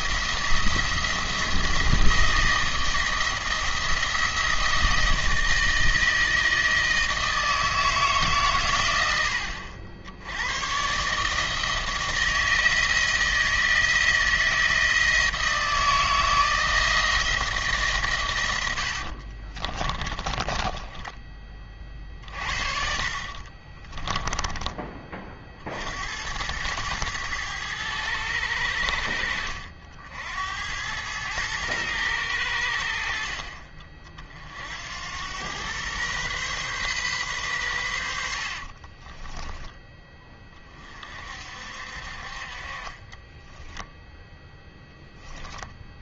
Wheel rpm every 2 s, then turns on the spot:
170, 160, 160, 160, 120, 110, 160, 160, 160, 100, 20, 50, 20, 110, 80, 90, 80, 60, 130, 50, 30, 40, 10.
18-22 38-40 44-46